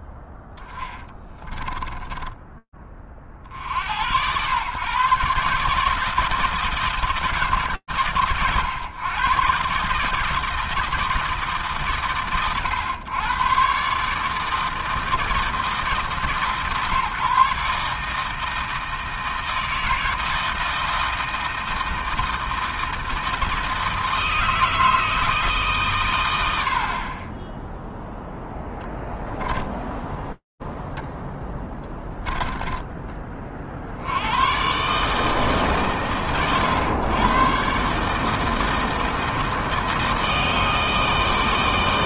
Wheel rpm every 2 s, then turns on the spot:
10, 10, 120, 160, 110, 160, 110, 160, 130, 160, 160, 160, 160, 110, 0, 0, 10, 120, 90, 160, 160.
0-2 32-34